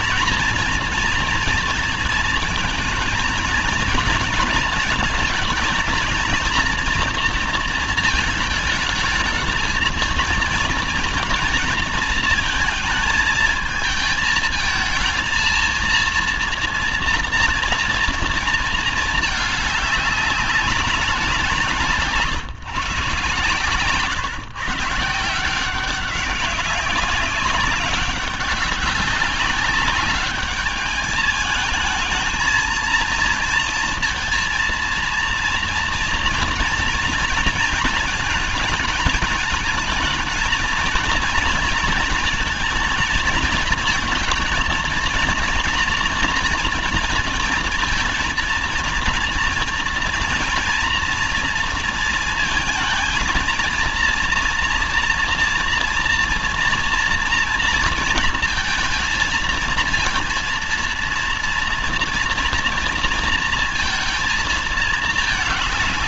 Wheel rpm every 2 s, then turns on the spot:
230, 220, 230, 230, 220, 230, 220, 230, 230, 220, 200, 140, 150, 200, 200, 210, 230, 230, 230, 220, 230, 230, 230, 230, 230, 230, 230, 230, 240, 230, 230, 230, 220.
none